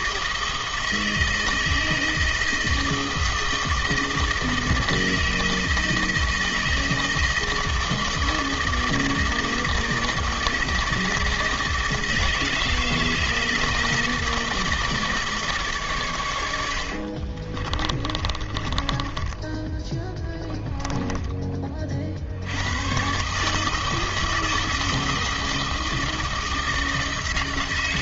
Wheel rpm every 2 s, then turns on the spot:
160, 160, 160, 160, 160, 160, 160, 160, 90, 30, 10, 80, 160, 160.
18-22